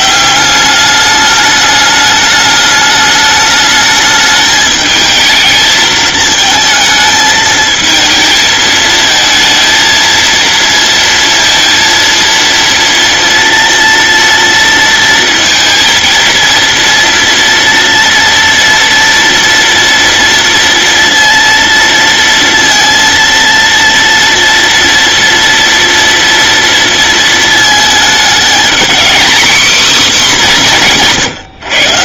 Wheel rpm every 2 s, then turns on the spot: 200, 210, 220, 220, 220, 230, 230, 230, 230, 230, 230, 230, 230, 230, 220, 180.
none